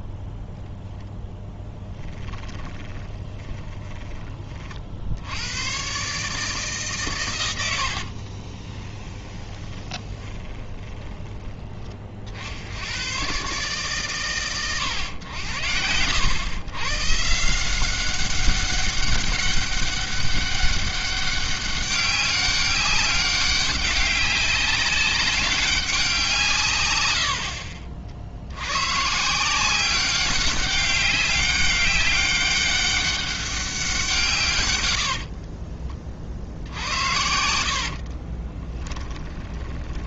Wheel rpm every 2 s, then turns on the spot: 0, 10, 50, 140, 20, 20, 90, 100, 120, 200, 200, 200, 200, 140, 110, 200, 200, 110, 60, 20.
2-4 8-12 38-40